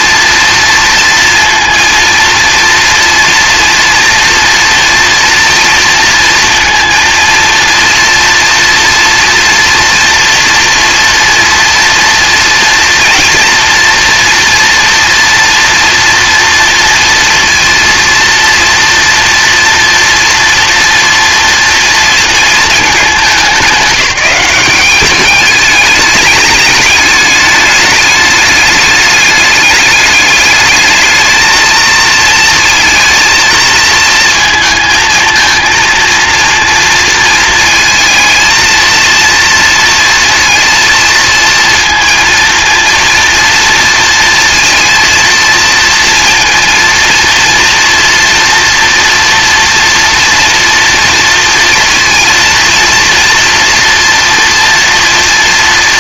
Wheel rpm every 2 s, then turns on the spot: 230, 230, 240, 230, 230, 230, 230, 230, 230, 230, 240, 220, 190, 210, 210, 210, 220, 230, 230, 230, 230, 230, 230, 230, 230, 230, 230, 230.
none